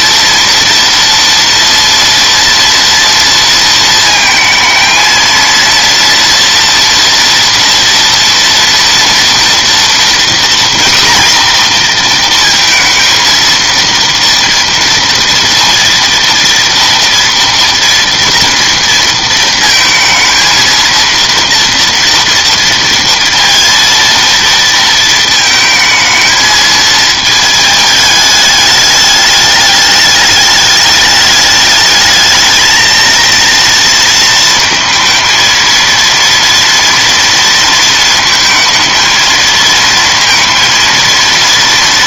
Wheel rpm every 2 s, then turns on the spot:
230, 230, 230, 230, 230, 240, 230, 230, 230, 230, 230, 230, 220, 220, 210, 210, 230, 230, 230, 230, 230.
none